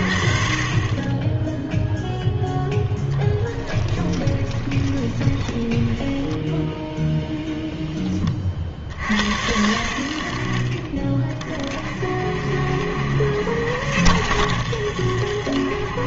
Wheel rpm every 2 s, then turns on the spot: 30, 0, 20, 10, 50, 50, 60, 80.
4-8